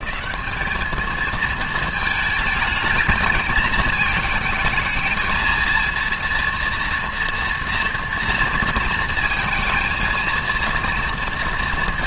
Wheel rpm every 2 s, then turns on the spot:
200, 220, 220, 230, 230, 230.
none